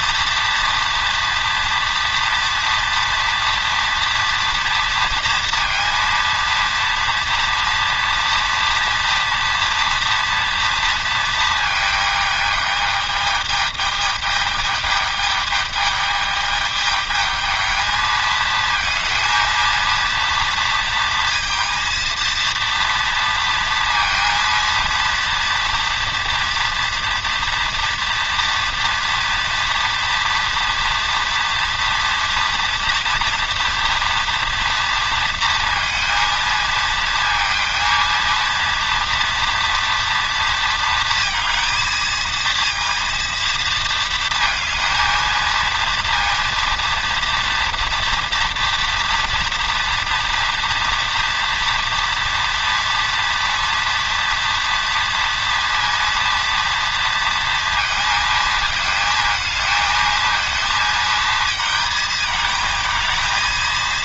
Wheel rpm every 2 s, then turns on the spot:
230, 240, 240, 230, 230, 240, 220, 210, 210, 220, 230, 230, 230, 230, 230, 230, 230, 230, 230, 230, 230, 230, 230, 230, 230, 230, 230, 230, 230, 220, 230, 220.
none